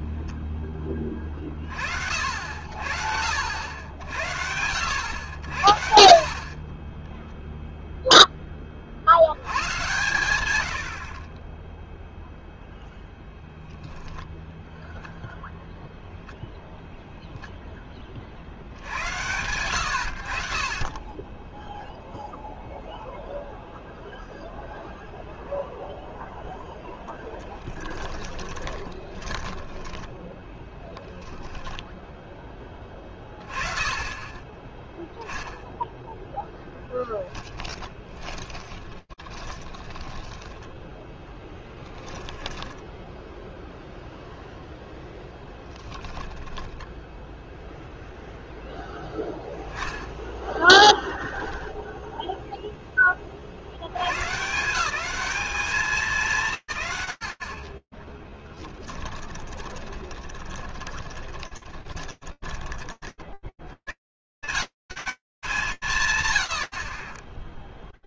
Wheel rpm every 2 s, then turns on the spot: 10, 60, 90, 0, 60, 70, 0, 0, 0, 80, 20, 0, 0, 0, 20, 0, 20, 10, 10, 10, 10, 0, 10, 0, 0, 10, 100, 210, 20, 20, 20, 20, 170, 100.
28-30 36-42 44-46 58-62